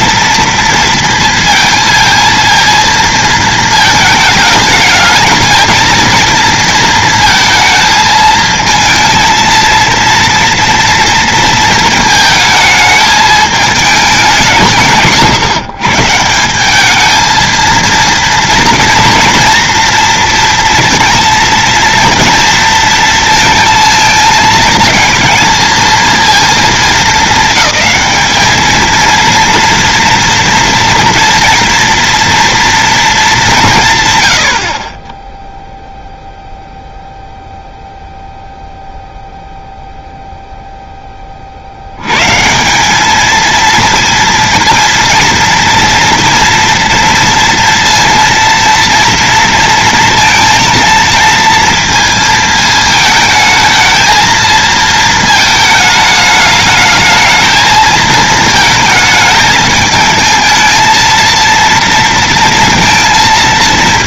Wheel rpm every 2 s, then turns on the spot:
230, 230, 210, 230, 220, 230, 220, 170, 210, 230, 230, 230, 220, 210, 220, 230, 230, 40, 0, 0, 10, 200, 230, 240, 230, 230, 220, 230, 210, 220, 220, 230.
none